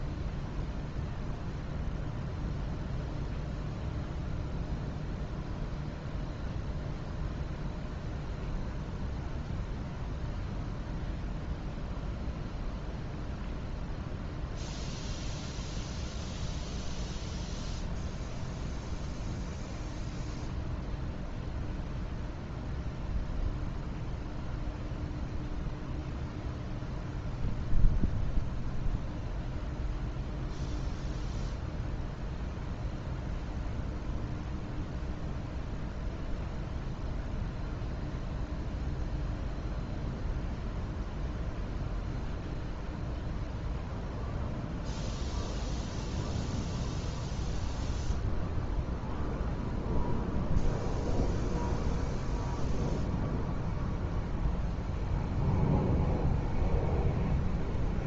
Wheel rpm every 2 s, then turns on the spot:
0, 0, 0, 0, 0, 0, 0, 0, 0, 0, 0, 0, 0, 0, 0, 0, 0, 0, 0, 0, 0, 0, 0, 0, 0, 0, 0, 0, 0.
none